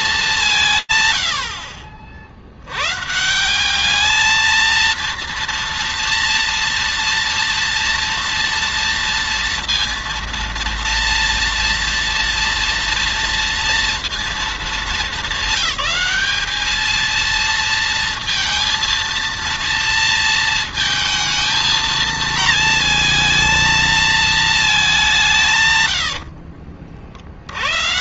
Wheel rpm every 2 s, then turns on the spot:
80, 230, 230, 230, 230, 230, 220, 220, 230, 230, 220, 200, 70, 200.
none